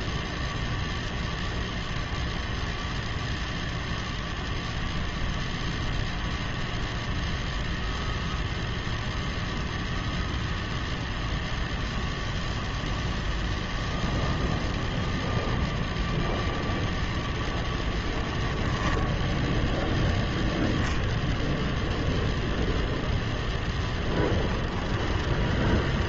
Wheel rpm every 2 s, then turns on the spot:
0, 0, 0, 0, 0, 0, 0, 0, 0, 10, 0, 10, 10.
24-26